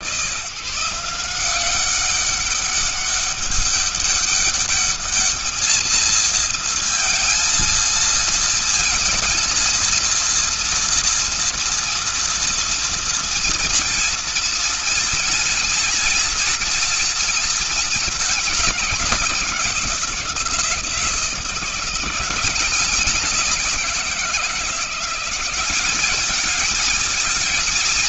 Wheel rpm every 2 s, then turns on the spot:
170, 200, 210, 230, 230, 230, 230, 230, 230, 190, 170, 190, 180, 220.
none